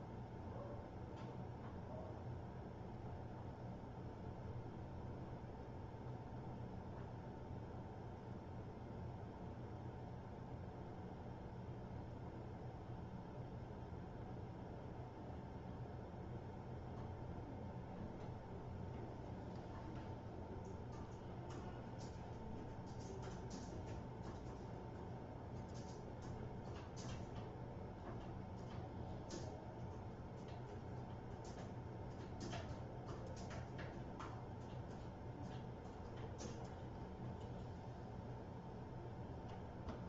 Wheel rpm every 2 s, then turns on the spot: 0, 0, 0, 0, 0, 0, 0, 0, 0, 0, 0, 0, 0, 0, 0, 0, 0, 0, 0, 0.
none